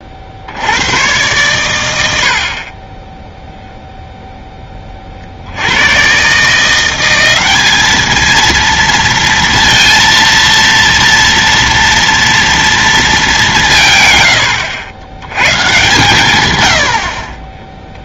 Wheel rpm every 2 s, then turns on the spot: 50, 60, 10, 150, 220, 230, 230, 110, 120.
none